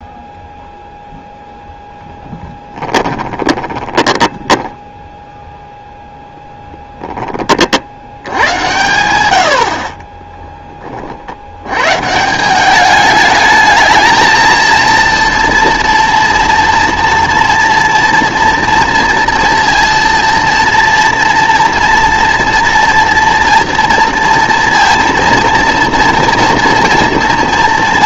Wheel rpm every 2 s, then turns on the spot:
0, 20, 10, 10, 100, 20, 200, 230, 230, 230, 230, 240, 230, 240.
2-8